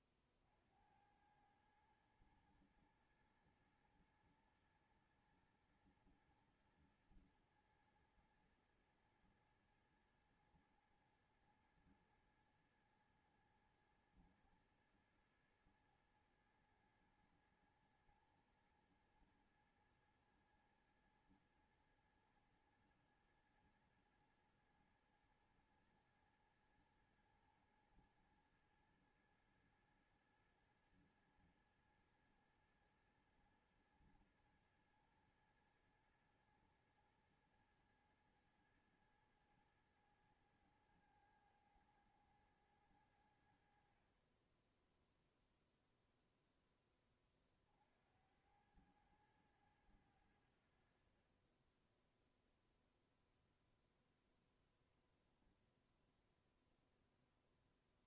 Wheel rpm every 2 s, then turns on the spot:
50, 110, 120, 110, 110, 110, 110, 110, 110, 110, 110, 110, 110, 110, 110, 110, 110, 110, 110, 110, 110, 110, 30, 0, 80, 90, 10, 0, 0.
none